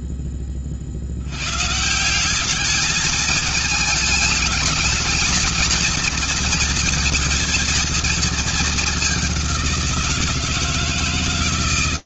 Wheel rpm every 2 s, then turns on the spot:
10, 190, 220, 230, 220, 170.
none